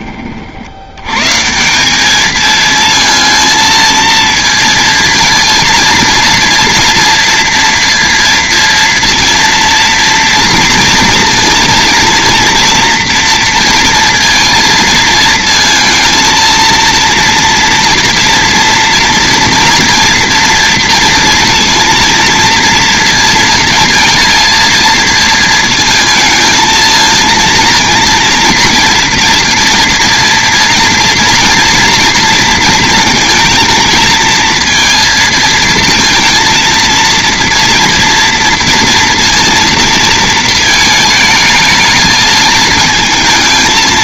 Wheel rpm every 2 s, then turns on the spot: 60, 220, 230, 230, 230, 230, 230, 230, 230, 230, 230, 230, 230, 220, 240, 230, 230, 230, 220, 230, 220, 220.
none